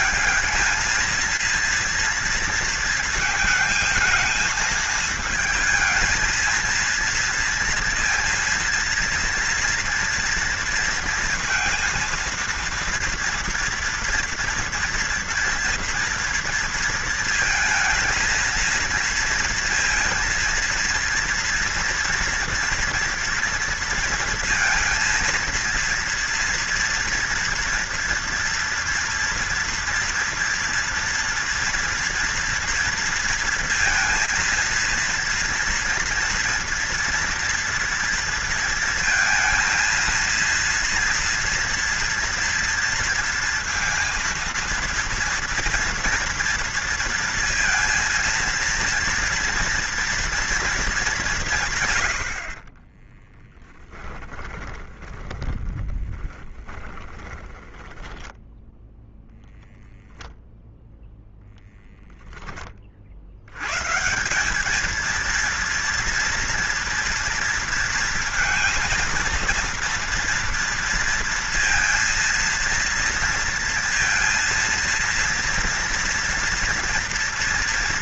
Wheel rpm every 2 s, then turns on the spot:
220, 230, 220, 230, 230, 230, 230, 240, 230, 230, 230, 230, 230, 230, 240, 240, 230, 230, 230, 230, 230, 230, 230, 230, 230, 210, 30, 20, 20, 0, 0, 50, 220, 230, 230, 230, 230, 230, 230.
52-58